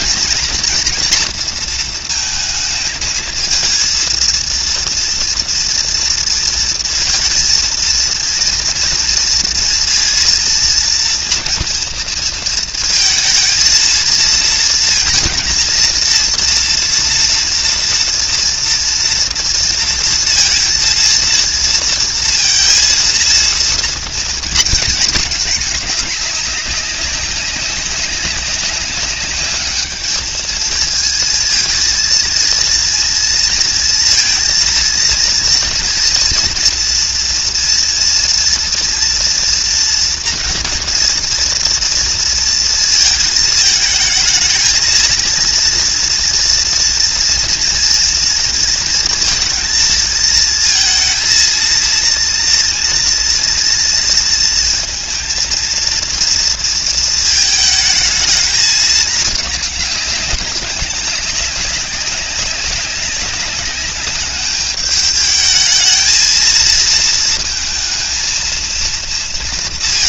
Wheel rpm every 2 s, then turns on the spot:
230, 220, 230, 230, 230, 230, 220, 230, 230, 230, 230, 230, 230, 200, 200, 230, 230, 230, 230, 240, 230, 230, 220, 230, 230, 230, 230, 230, 230, 210, 200, 200, 210, 230, 230.
none